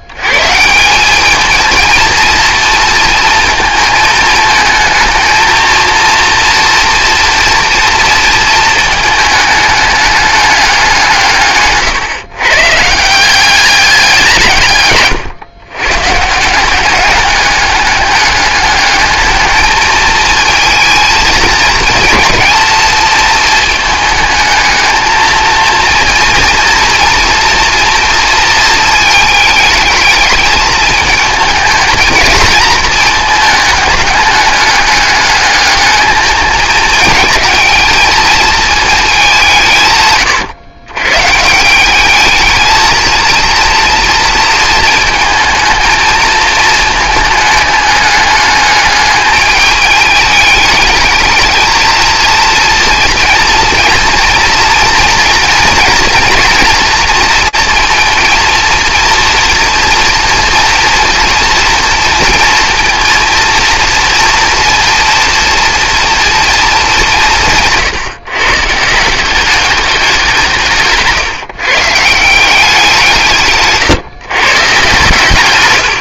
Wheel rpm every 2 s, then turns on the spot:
150, 230, 220, 230, 220, 200, 130, 160, 160, 200, 220, 220, 220, 230, 230, 220, 230, 210, 210, 220, 130, 220, 230, 220, 210, 210, 230, 230, 230, 230, 230, 230, 230, 230, 150, 180, 180, 140.
none